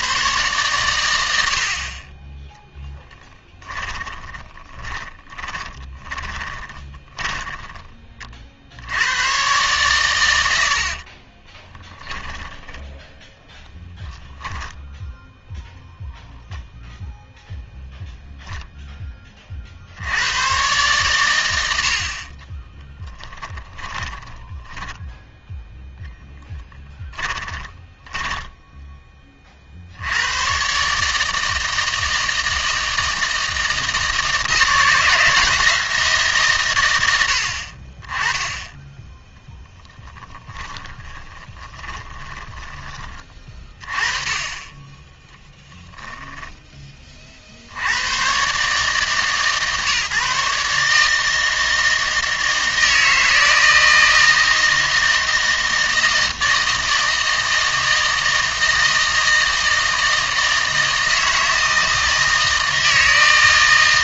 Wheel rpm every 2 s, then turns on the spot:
120, 10, 40, 30, 70, 70, 10, 0, 0, 0, 120, 20, 10, 10, 10, 130, 160, 170, 120, 10, 20, 20, 20, 10, 130, 150, 160, 160, 160, 160, 160, 160.
2-8 10-14 22-30 40-42